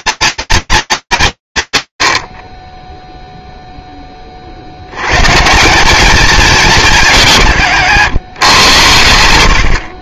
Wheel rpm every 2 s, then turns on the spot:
240, 50, 80, 200, 110.
none